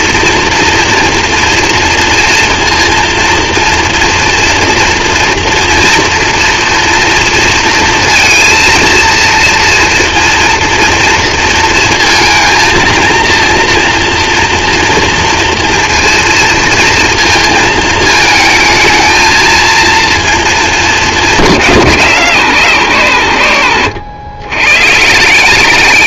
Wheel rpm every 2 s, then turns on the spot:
230, 230, 230, 230, 230, 230, 230, 230, 230, 220, 220, 140, 120.
none